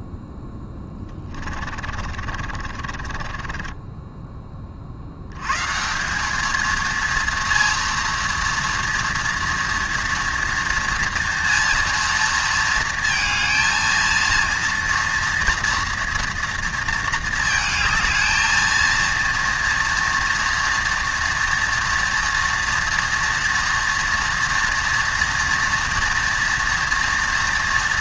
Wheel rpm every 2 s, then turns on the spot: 10, 40, 50, 220, 230, 230, 230, 230, 230, 230, 230, 230, 230, 230.
0-4